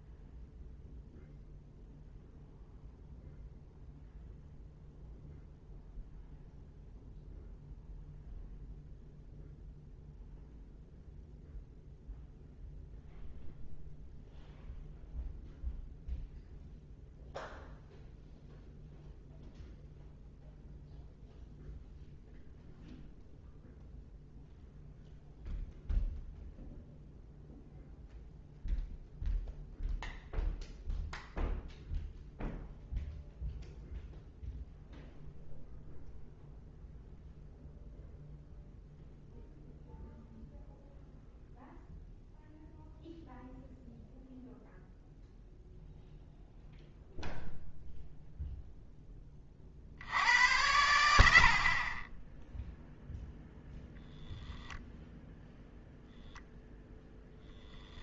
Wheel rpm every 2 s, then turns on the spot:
0, 0, 0, 0, 0, 0, 0, 0, 0, 0, 0, 0, 0, 0, 0, 0, 0, 0, 0, 0, 0, 0, 0, 0, 0, 90, 10, 0, 0.
none